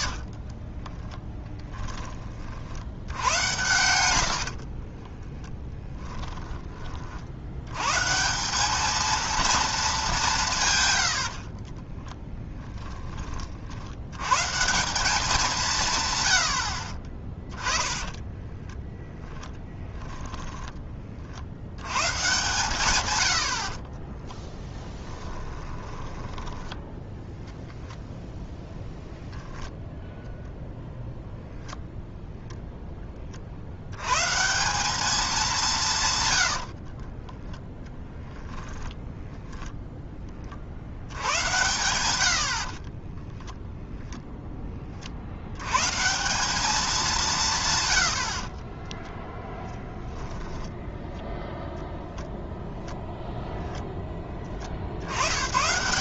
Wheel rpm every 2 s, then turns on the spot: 30, 60, 70, 10, 190, 150, 10, 140, 80, 20, 10, 130, 10, 10, 0, 0, 0, 170, 90, 0, 50, 60, 10, 200, 50, 10, 0, 40.
0-2 4-6 12-14 18-20 24-28 36-38 42-44 48-50